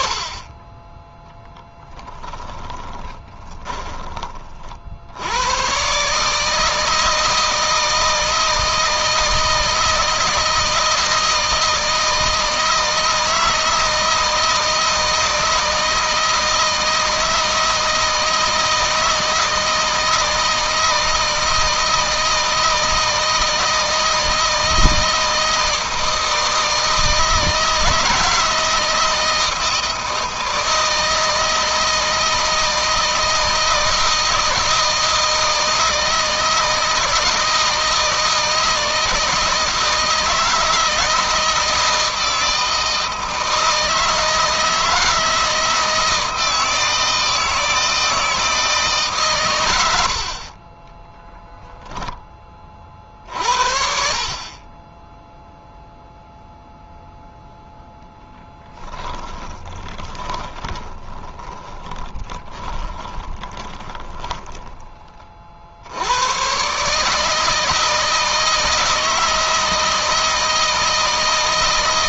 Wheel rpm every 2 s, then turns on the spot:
10, 20, 60, 160, 160, 160, 160, 160, 160, 160, 160, 160, 160, 160, 160, 160, 160, 160, 160, 160, 160, 160, 160, 160, 150, 20, 40, 20, 0, 20, 20, 20, 20, 140, 160, 160.
2-4 50-52 58-64